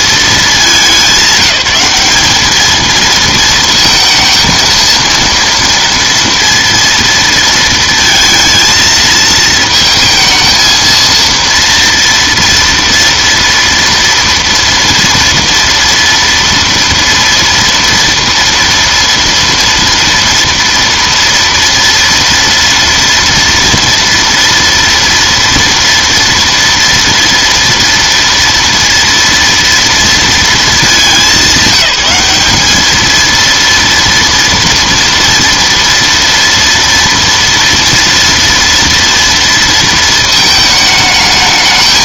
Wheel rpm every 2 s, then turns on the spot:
210, 210, 230, 230, 230, 230, 230, 230, 230, 230, 230, 230, 230, 230, 230, 220, 210, 230, 230, 230, 220.
none